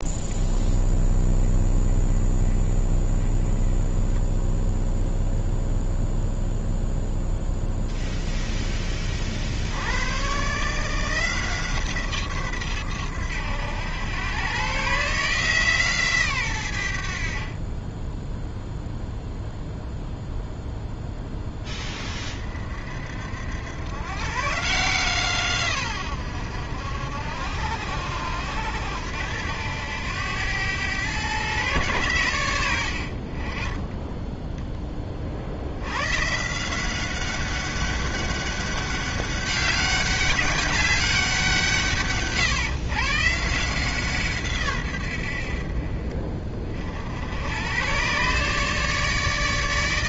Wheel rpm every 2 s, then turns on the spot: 20, 10, 0, 0, 50, 170, 100, 150, 60, 0, 10, 70, 150, 70, 90, 120, 30, 50, 190, 200, 190, 150, 70, 70, 150.
none